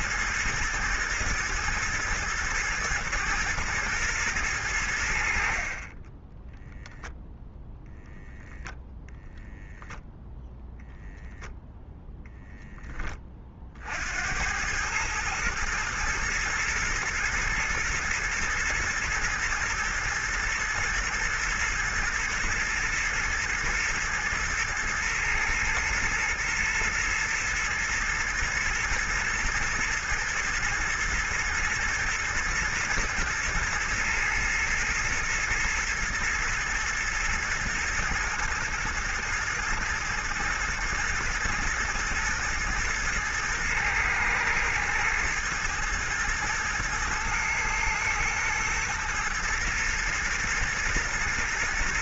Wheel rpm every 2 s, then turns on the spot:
110, 120, 90, 0, 0, 10, 20, 110, 110, 120, 120, 120, 110, 110, 110, 110, 110, 120, 120, 120, 110, 120, 110, 110, 110, 120.
none